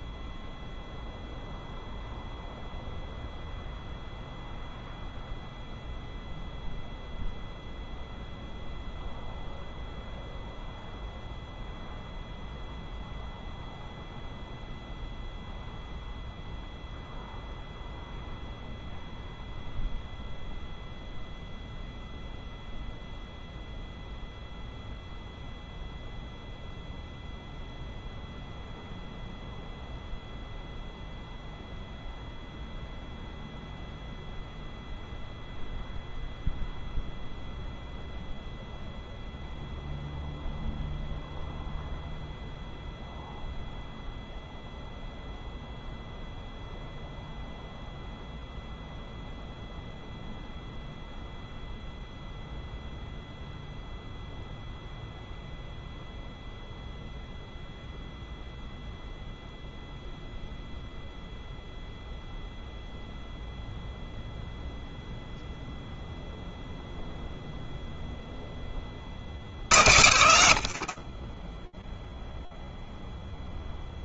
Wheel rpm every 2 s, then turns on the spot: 0, 0, 0, 0, 0, 0, 0, 0, 0, 0, 0, 0, 0, 0, 0, 0, 0, 0, 0, 0, 0, 0, 0, 0, 0, 0, 0, 0, 0, 0, 0, 0, 0, 0, 40, 40, 0.
68-72